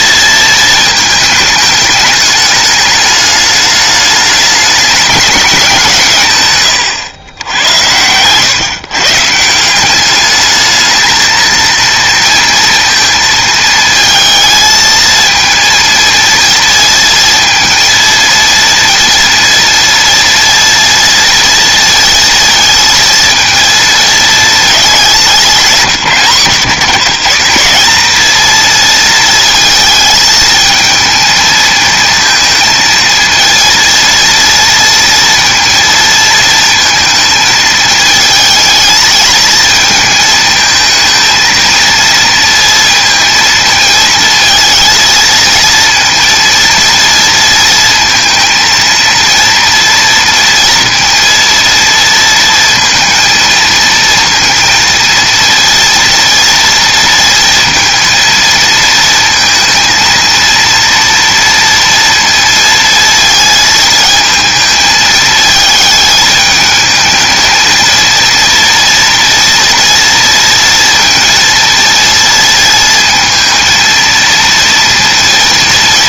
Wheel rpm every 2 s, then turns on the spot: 230, 210, 210, 130, 130, 210, 230, 220, 230, 230, 230, 230, 220, 140, 220, 220, 220, 230, 220, 220, 220, 230, 220, 230, 230, 230, 230, 230, 230, 220, 230, 230, 220, 220, 230, 230, 230, 230.
6-8